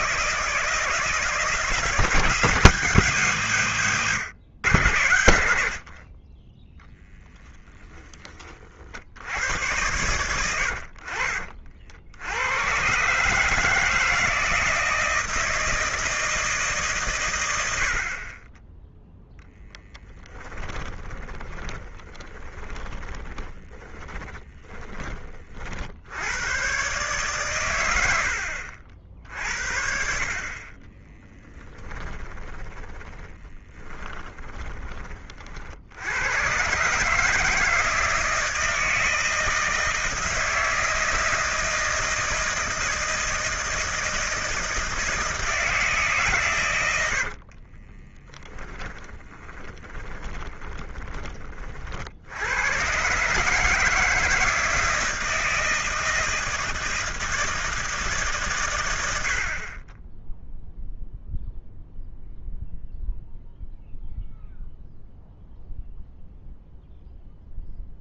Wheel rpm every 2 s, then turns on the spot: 160, 160, 100, 10, 50, 70, 120, 160, 140, 10, 20, 20, 30, 120, 60, 30, 10, 20, 130, 160, 160, 160, 160, 110, 20, 20, 110, 160, 160, 120, 0, 0, 0, 0.
20-26 30-34 48-52